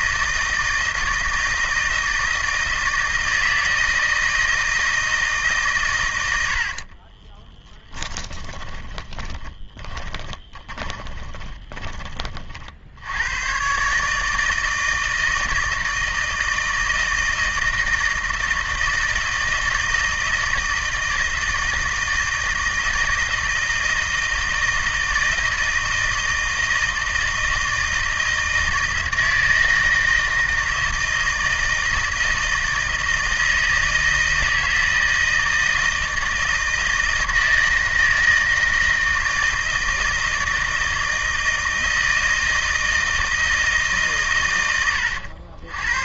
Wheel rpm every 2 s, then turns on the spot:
160, 160, 160, 20, 10, 20, 80, 160, 160, 160, 160, 160, 160, 160, 160, 160, 160, 160, 160, 160, 160, 160, 100.
6-12